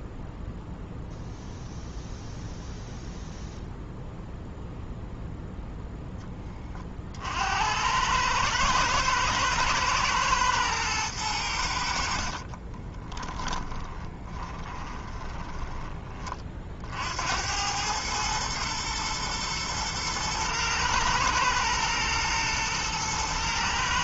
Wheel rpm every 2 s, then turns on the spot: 0, 0, 0, 40, 110, 110, 20, 20, 70, 110, 110, 110.
12-16